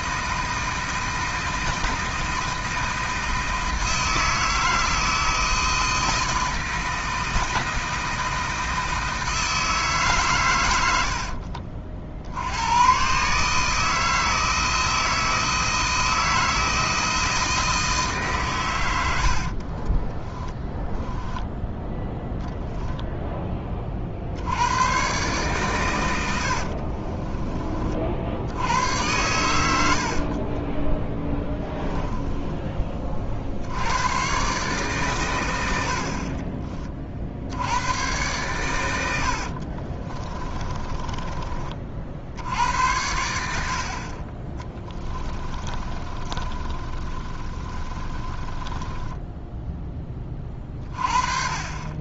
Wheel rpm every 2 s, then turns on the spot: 160, 160, 160, 160, 160, 110, 100, 160, 160, 130, 10, 0, 90, 60, 90, 20, 20, 140, 30, 100, 30, 80, 10, 30, 20, 30.
20-22 26-28 30-32 40-42 44-50